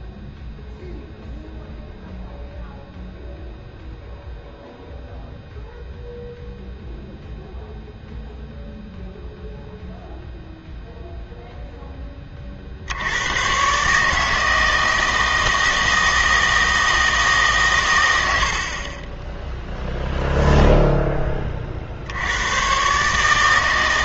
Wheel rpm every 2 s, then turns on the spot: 0, 0, 0, 0, 0, 0, 50, 160, 160, 80, 0, 110.
none